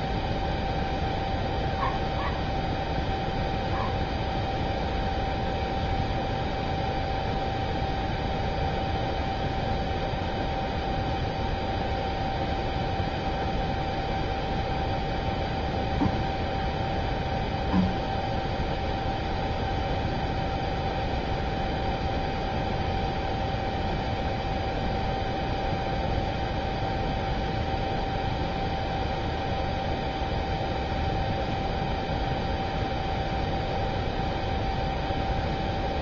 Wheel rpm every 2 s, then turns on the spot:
0, 0, 0, 0, 0, 0, 0, 0, 0, 0, 0, 0, 0, 0, 0, 0, 0, 0.
none